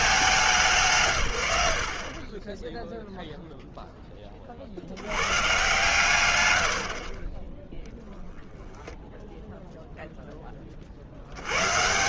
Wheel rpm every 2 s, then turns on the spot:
70, 20, 120, 20, 0, 160.
none